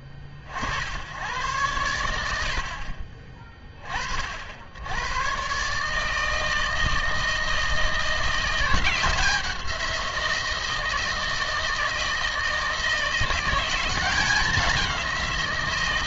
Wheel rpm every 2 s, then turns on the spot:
80, 60, 80, 160, 170, 170, 160, 190.
none